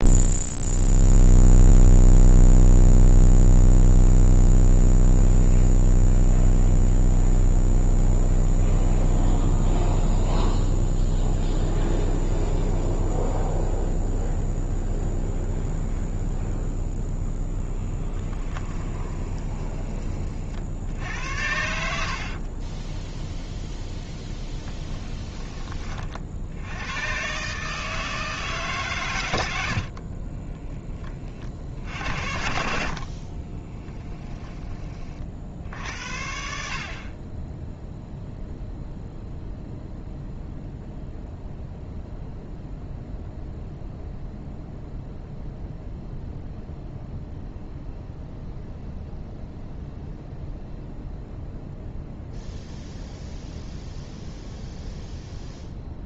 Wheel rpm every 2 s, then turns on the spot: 0, 0, 0, 0, 0, 0, 0, 0, 0, 20, 60, 20, 10, 90, 130, 10, 50, 30, 50, 0, 0, 0, 0, 0, 0, 0, 0, 0.
18-20 22-24